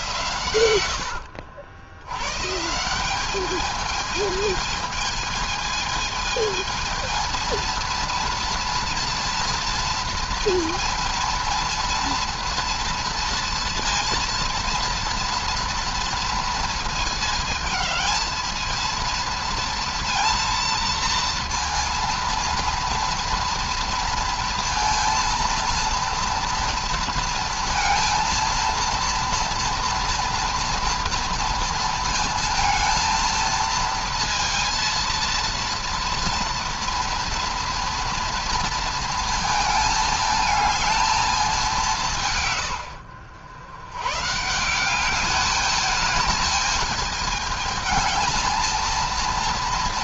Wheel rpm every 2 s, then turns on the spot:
100, 160, 220, 220, 230, 230, 230, 230, 230, 230, 230, 230, 230, 230, 230, 240, 230, 230, 230, 230, 220, 100, 170, 210, 230.
0-2